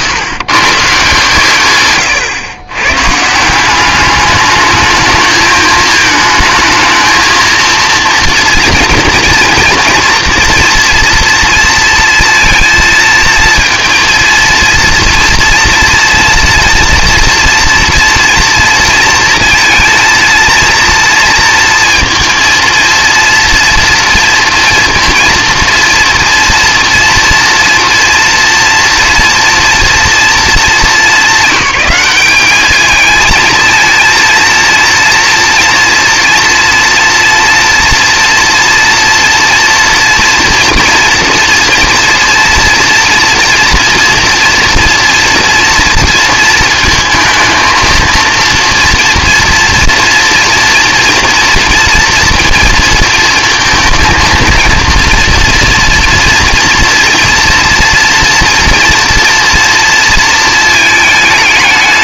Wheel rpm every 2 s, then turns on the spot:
140, 120, 210, 220, 230, 230, 230, 230, 230, 230, 230, 230, 230, 230, 240, 220, 200, 230, 230, 230, 240, 230, 230, 230, 230, 230, 230, 230, 230, 230, 220.
none